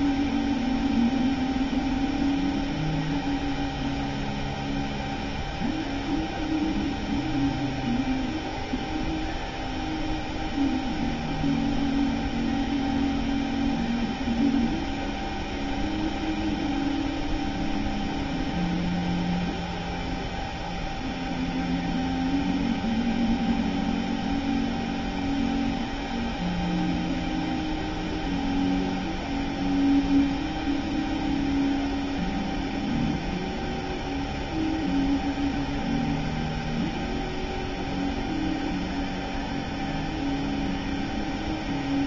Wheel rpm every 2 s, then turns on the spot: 0, 0, 0, 0, 0, 0, 0, 0, 0, 0, 0, 0, 0, 0, 0, 0, 0, 0, 0, 0, 0.
none